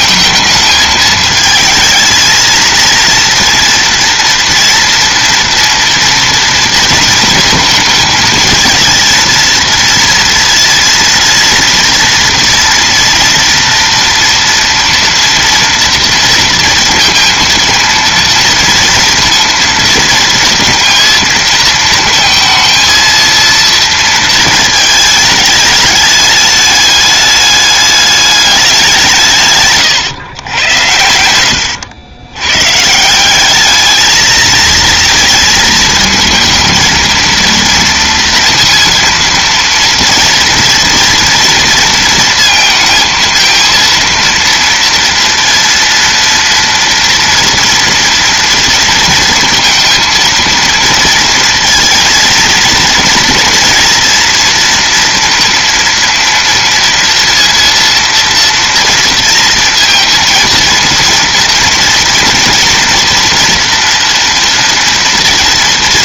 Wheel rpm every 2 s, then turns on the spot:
220, 220, 230, 230, 220, 230, 230, 230, 230, 230, 230, 230, 220, 210, 210, 110, 120, 220, 230, 230, 230, 230, 230, 230, 240, 230, 230, 230, 230, 230, 230, 230, 230.
none